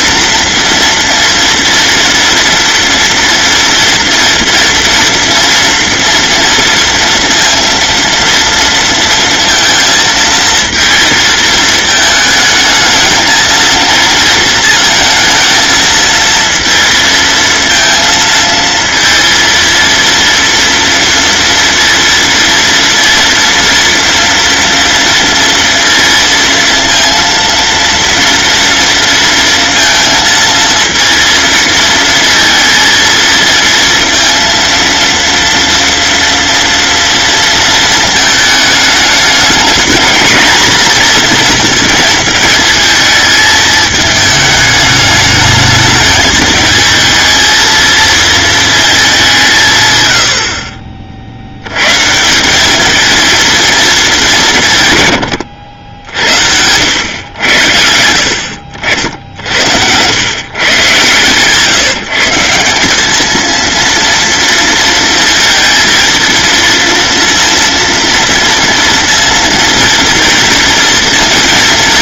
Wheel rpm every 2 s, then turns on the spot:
230, 230, 230, 230, 230, 230, 220, 230, 230, 230, 230, 230, 230, 230, 230, 230, 230, 230, 230, 210, 230, 220, 210, 220, 210, 50, 220, 110, 100, 70, 140, 200, 230, 230, 230, 230.
58-60